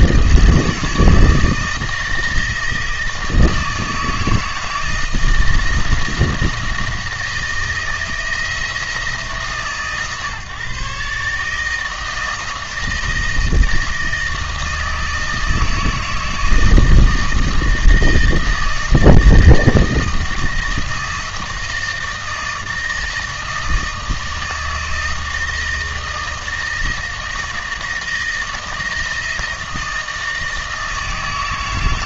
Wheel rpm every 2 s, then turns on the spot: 160, 160, 160, 160, 160, 140, 160, 160, 160, 160, 160, 160, 160, 160, 160, 160.
none